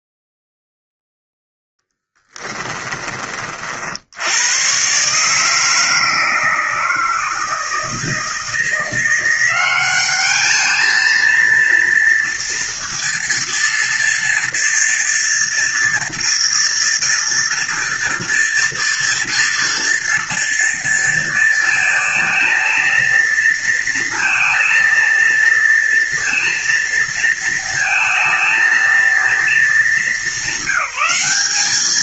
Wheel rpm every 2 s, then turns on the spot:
0, 30, 140, 160, 180, 230, 240, 230, 230, 230, 230, 230, 230, 230, 230, 200.
none